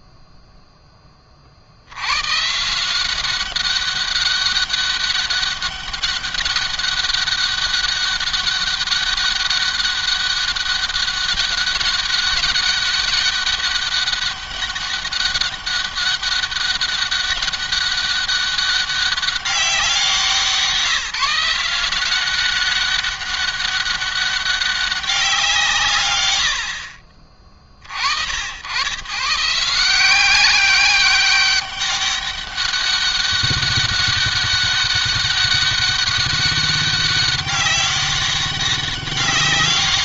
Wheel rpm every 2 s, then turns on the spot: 0, 140, 200, 200, 200, 200, 200, 200, 200, 200, 170, 190, 200, 70, 100, 190, 200, 200, 200, 190.
none